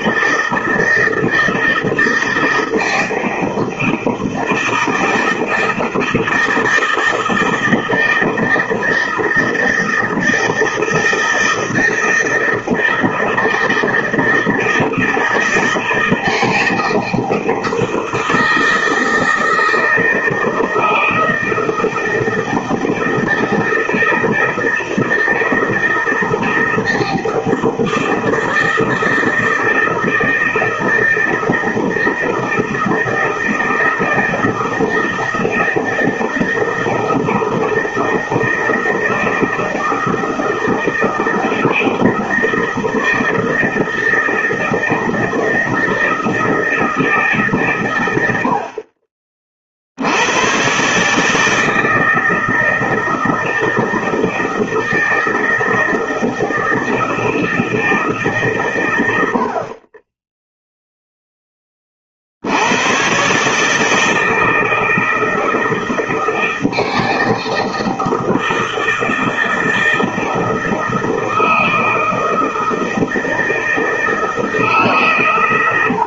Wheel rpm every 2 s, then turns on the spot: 160, 160, 160, 160, 160, 160, 160, 160, 160, 160, 160, 160, 160, 160, 160, 160, 160, 160, 160, 160, 160, 160, 160, 160, 40, 140, 160, 160, 160, 140, 0, 110, 160, 160, 160, 160, 160, 140.
none